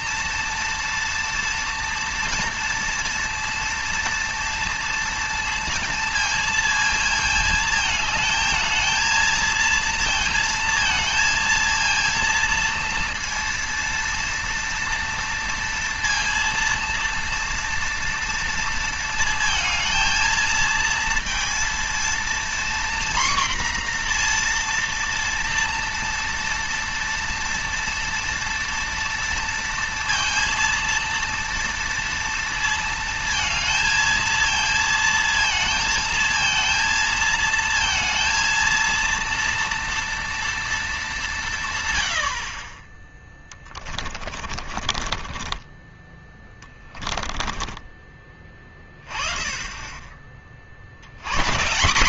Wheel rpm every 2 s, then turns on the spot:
230, 230, 230, 220, 220, 230, 230, 230, 230, 230, 230, 240, 240, 230, 230, 230, 230, 230, 230, 230, 220, 30, 40, 20, 30, 70.
44-48